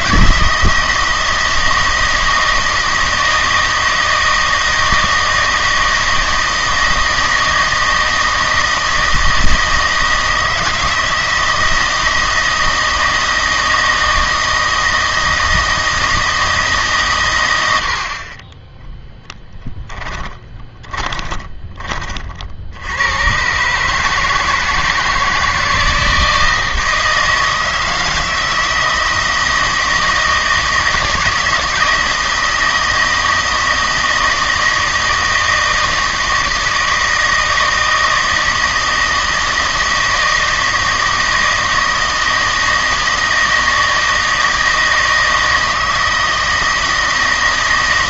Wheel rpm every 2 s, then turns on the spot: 160, 160, 160, 160, 160, 160, 160, 160, 140, 20, 20, 80, 160, 160, 160, 160, 160, 160, 160, 160, 160, 160, 160, 160.
20-22